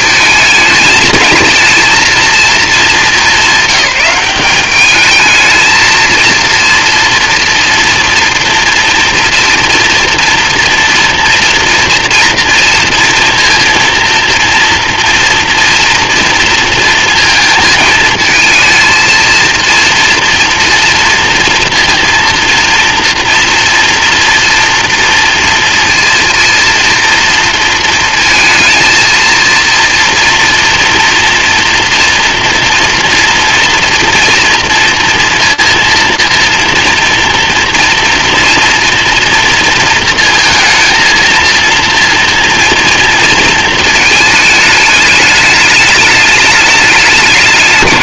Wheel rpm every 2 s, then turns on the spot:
220, 220, 200, 230, 230, 230, 230, 230, 230, 220, 230, 230, 230, 230, 230, 230, 240, 230, 230, 230, 230, 230, 210, 210.
none